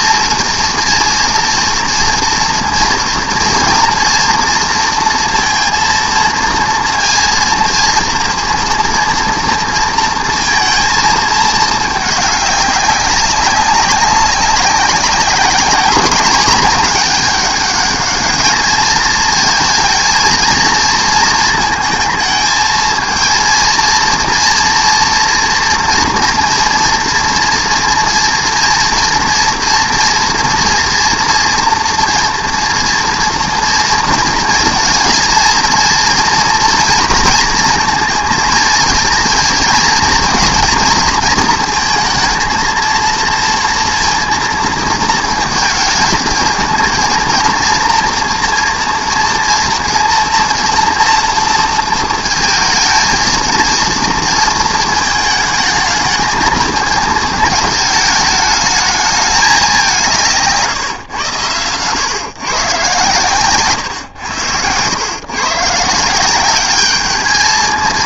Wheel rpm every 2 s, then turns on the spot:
230, 230, 230, 230, 230, 230, 200, 190, 210, 220, 230, 220, 230, 230, 230, 230, 230, 230, 230, 230, 230, 230, 230, 230, 240, 230, 230, 230, 220, 210, 150, 130, 100, 200.
none